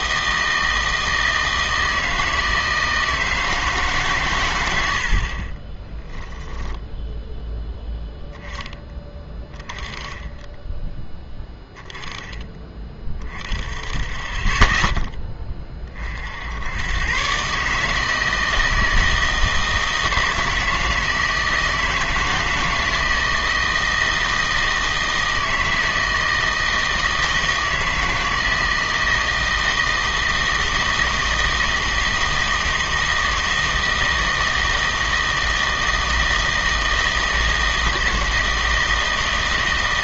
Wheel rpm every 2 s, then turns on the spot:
160, 160, 90, 10, 10, 10, 20, 10, 90, 160, 160, 160, 160, 160, 160, 160, 160, 160, 160, 160.
6-8